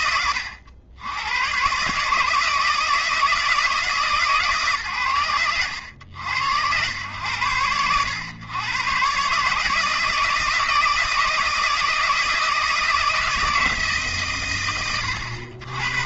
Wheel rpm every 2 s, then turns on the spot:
90, 160, 110, 90, 130, 160, 160, 70.
none